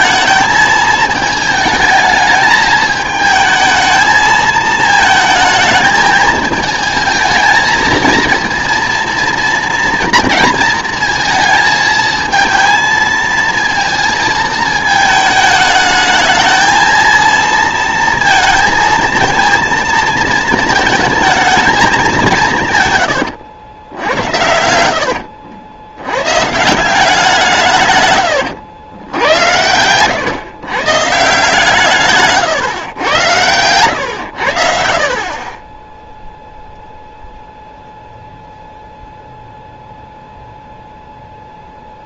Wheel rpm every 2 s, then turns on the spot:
220, 210, 220, 220, 230, 230, 220, 220, 220, 230, 220, 150, 80, 150, 100, 120, 120, 80, 0, 0, 0.
24-26